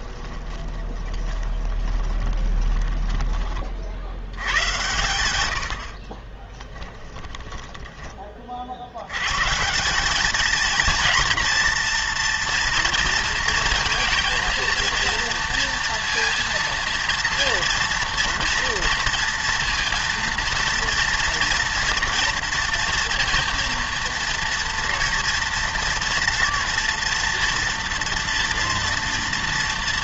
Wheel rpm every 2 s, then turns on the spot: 20, 20, 100, 20, 60, 220, 240, 230, 230, 230, 230, 230, 230, 230, 230.
0-4 6-8